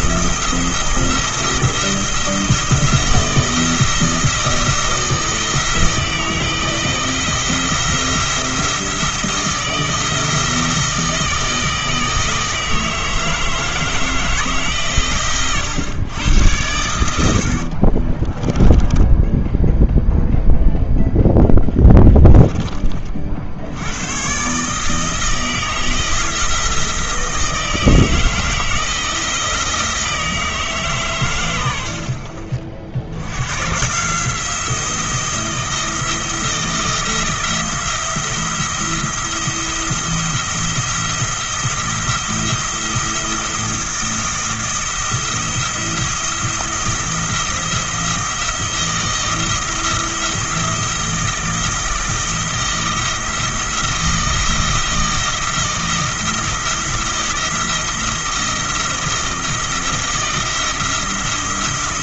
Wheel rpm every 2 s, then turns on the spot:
170, 170, 170, 160, 170, 160, 160, 140, 90, 10, 0, 20, 150, 160, 160, 150, 60, 170, 170, 170, 170, 170, 170, 170, 160, 170, 170, 160, 170, 170, 170.
18-20